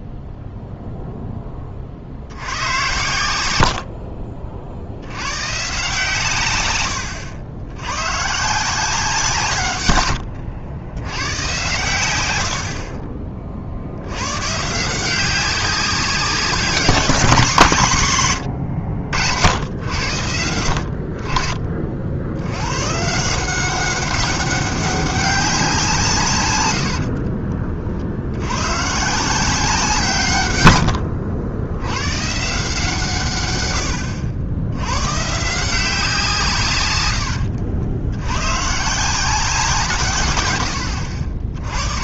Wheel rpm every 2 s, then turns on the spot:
0, 90, 50, 120, 150, 80, 80, 140, 180, 90, 80, 80, 200, 120, 100, 130, 140, 80, 150, 110, 120.
12-14 26-28